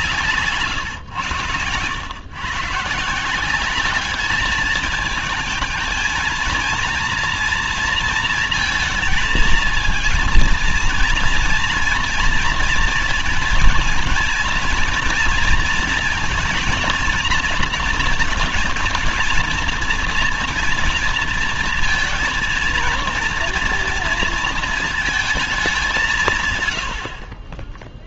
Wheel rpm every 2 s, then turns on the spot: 130, 140, 220, 230, 230, 230, 230, 230, 230, 230, 240, 230, 230, 130.
none